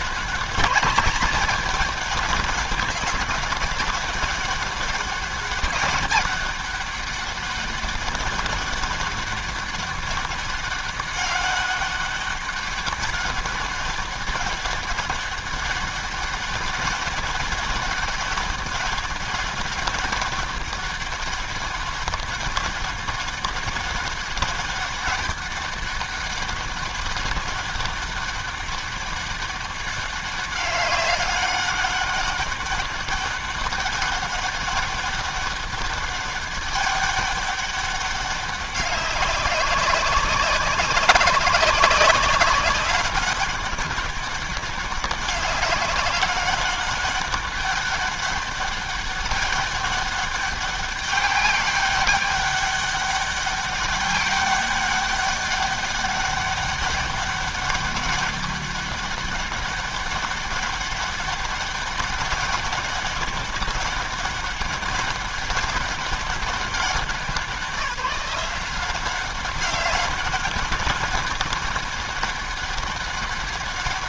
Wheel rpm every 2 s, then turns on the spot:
200, 200, 200, 200, 200, 200, 200, 200, 200, 200, 190, 200, 200, 200, 200, 200, 200, 200, 200, 200, 190, 190, 200, 200, 200, 200, 200, 200, 200, 200, 200, 200, 200, 200, 180, 200, 200.
none